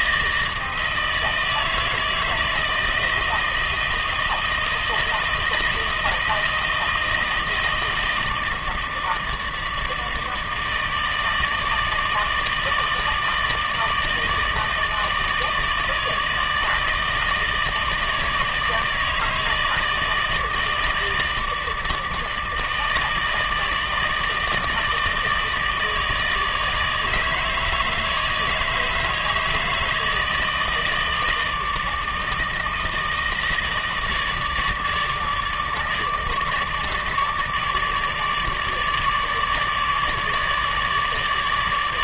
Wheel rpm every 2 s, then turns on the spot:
160, 160, 160, 160, 160, 160, 160, 160, 160, 160, 160, 160, 160, 150, 160, 160, 160, 160, 150, 150, 150.
none